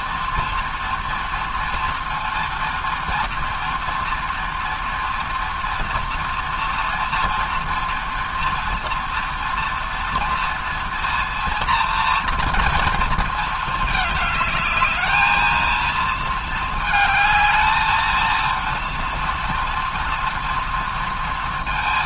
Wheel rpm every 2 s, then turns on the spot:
230, 230, 230, 230, 230, 230, 230, 210, 220, 230, 230.
none